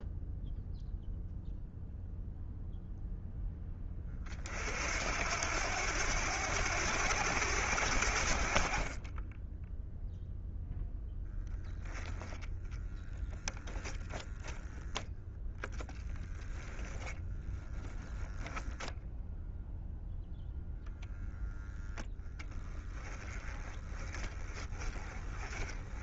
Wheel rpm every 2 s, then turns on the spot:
0, 0, 60, 90, 30, 10, 10, 0, 10, 10, 0, 10, 20.
12-14